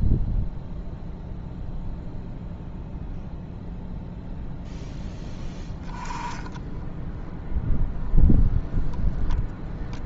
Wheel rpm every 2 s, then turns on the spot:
0, 0, 0, 10, 0.
6-8